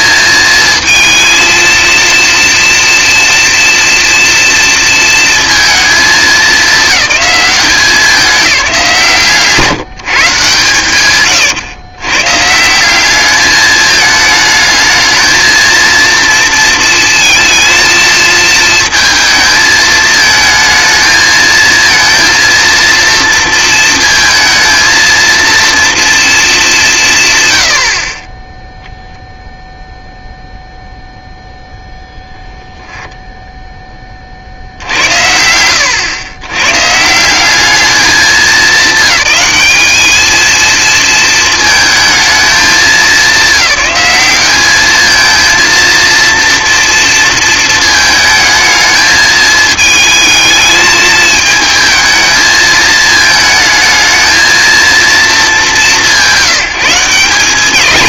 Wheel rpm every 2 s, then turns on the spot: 220, 230, 230, 210, 180, 140, 160, 220, 230, 230, 220, 230, 220, 220, 0, 0, 0, 70, 120, 200, 220, 210, 210, 230, 220, 220, 220, 230, 170.
none